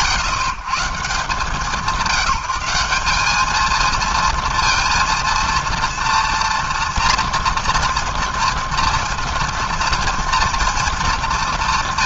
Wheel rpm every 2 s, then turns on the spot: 130, 190, 230, 230, 230, 220.
none